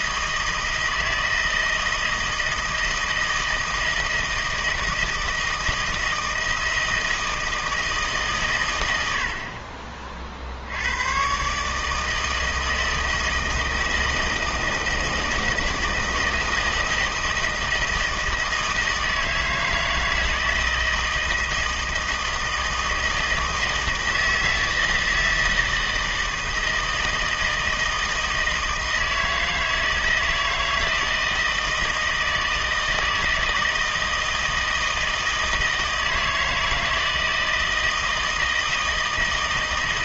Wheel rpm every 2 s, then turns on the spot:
160, 160, 160, 160, 110, 70, 160, 160, 160, 160, 160, 160, 160, 160, 160, 160, 160, 160, 160, 160.
none